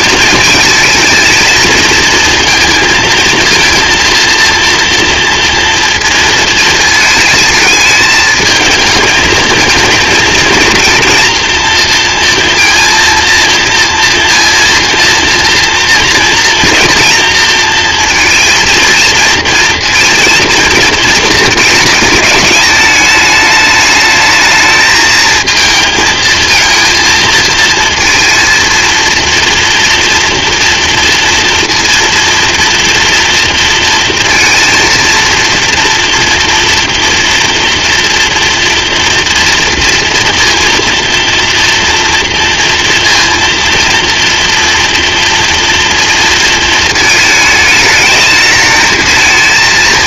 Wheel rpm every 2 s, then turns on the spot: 220, 230, 230, 220, 220, 230, 230, 230, 230, 230, 230, 210, 220, 230, 230, 230, 230, 230, 230, 240, 230, 230, 230, 220, 220.
none